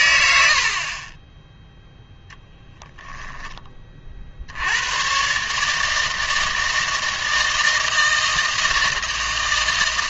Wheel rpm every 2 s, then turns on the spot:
70, 10, 80, 160, 160.
none